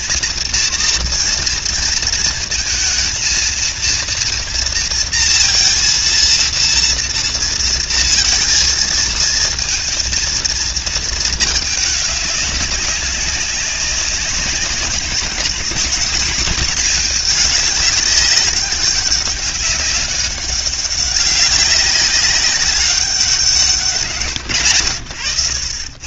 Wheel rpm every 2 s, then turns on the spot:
230, 230, 230, 230, 230, 230, 190, 190, 220, 190, 200, 190, 130.
none